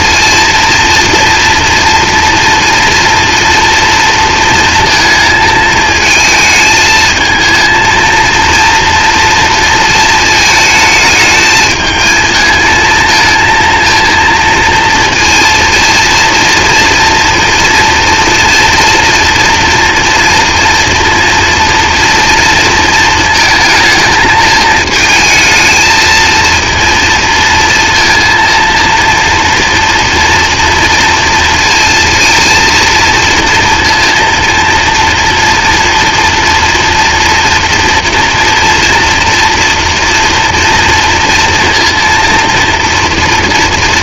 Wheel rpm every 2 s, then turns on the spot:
230, 230, 230, 220, 230, 220, 220, 230, 230, 230, 240, 230, 220, 230, 230, 230, 230, 230, 240, 230, 230, 230.
none